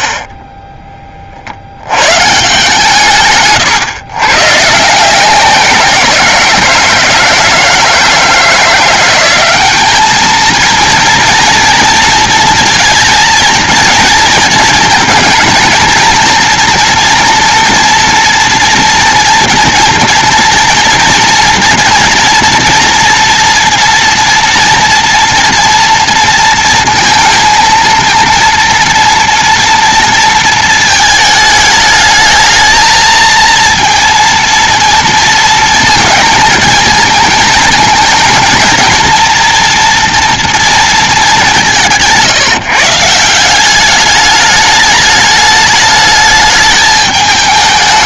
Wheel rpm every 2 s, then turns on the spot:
10, 150, 140, 170, 170, 220, 230, 230, 230, 230, 230, 230, 230, 230, 230, 230, 220, 230, 230, 220, 230, 160, 210, 210.
none